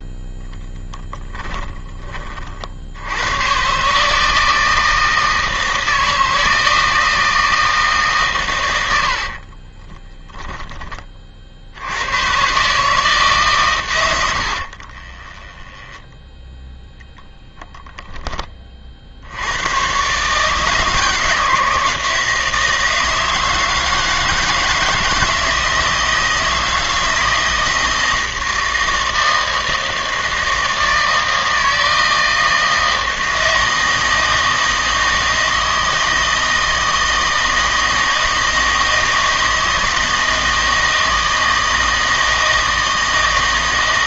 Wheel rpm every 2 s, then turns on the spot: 10, 60, 160, 160, 130, 20, 140, 60, 0, 20, 150, 160, 160, 160, 160, 160, 160, 160, 160, 160, 160, 160.
14-16